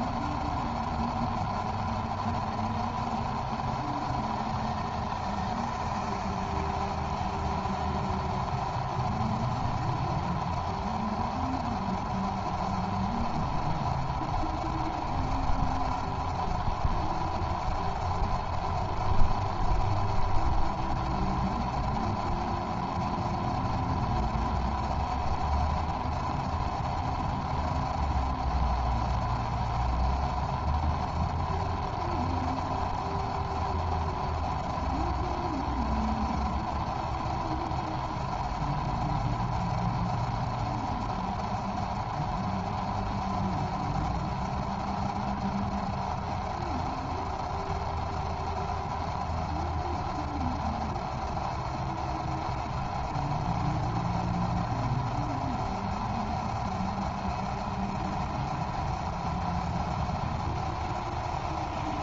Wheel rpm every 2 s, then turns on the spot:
0, 0, 0, 0, 0, 0, 0, 0, 0, 0, 0, 0, 0, 0, 0, 0, 0, 0, 0, 0, 0, 0, 0, 0, 0, 0, 0, 0, 0, 0, 0.
none